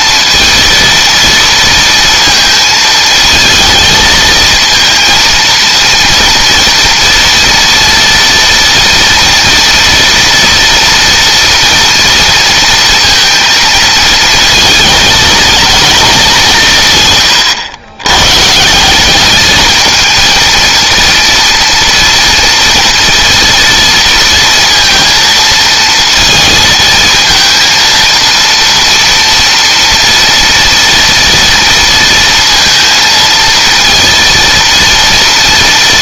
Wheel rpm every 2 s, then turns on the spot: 230, 220, 230, 230, 230, 240, 230, 220, 150, 180, 230, 230, 230, 220, 230, 230, 230, 230.
none